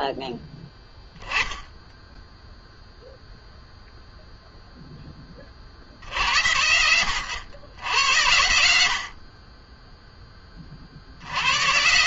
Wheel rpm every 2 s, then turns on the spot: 0, 60, 90, 40, 50, 20.
none